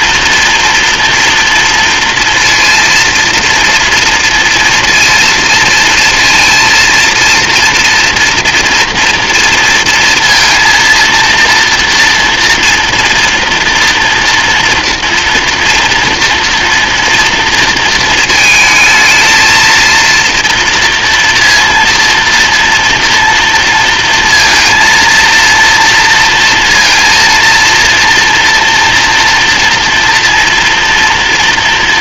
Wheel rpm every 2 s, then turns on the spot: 230, 230, 230, 230, 230, 230, 230, 230, 230, 220, 230, 230, 230, 230, 230, 230.
none